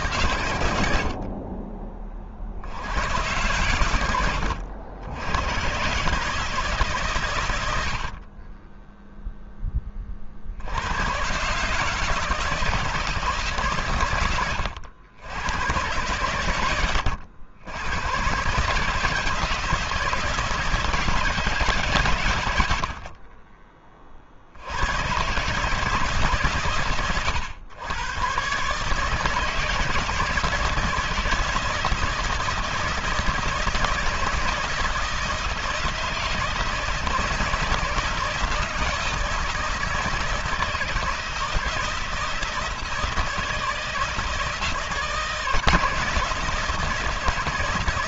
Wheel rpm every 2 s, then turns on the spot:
70, 90, 90, 130, 10, 90, 160, 90, 90, 150, 160, 50, 110, 120, 150, 160, 170, 170, 170, 160, 160, 160, 160, 160.
none